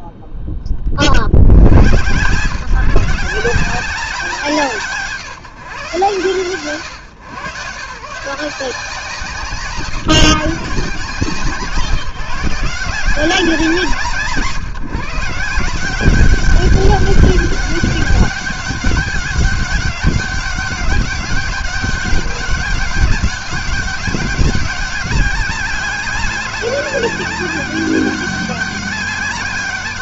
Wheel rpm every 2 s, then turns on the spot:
60, 170, 140, 120, 160, 170, 170, 150, 200, 200, 200, 200, 200, 200, 200.
none